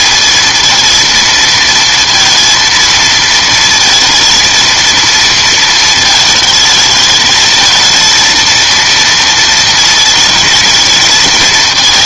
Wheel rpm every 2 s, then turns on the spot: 230, 230, 230, 220, 230, 220.
none